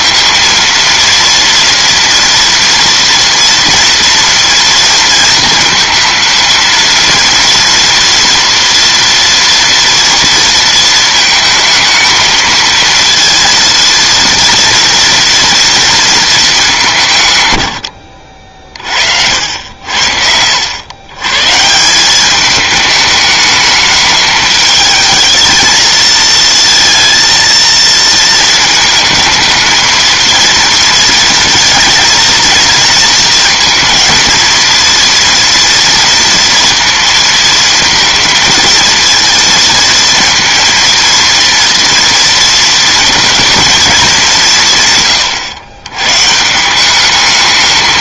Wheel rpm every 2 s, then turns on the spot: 230, 230, 230, 230, 230, 230, 230, 230, 200, 50, 90, 210, 220, 230, 220, 230, 220, 230, 230, 230, 230, 230, 160, 170.
none